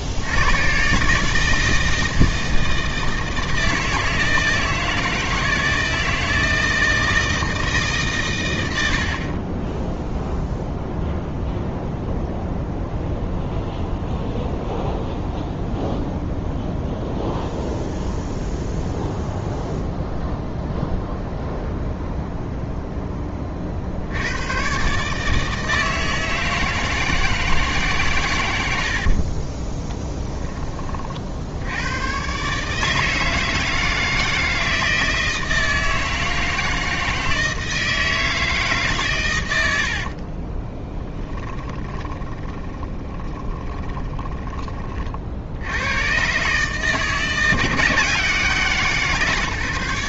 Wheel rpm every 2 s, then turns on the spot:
130, 160, 160, 160, 80, 0, 0, 0, 0, 0, 0, 0, 130, 160, 70, 30, 160, 160, 160, 140, 20, 20, 30, 150, 160.
28-30 40-44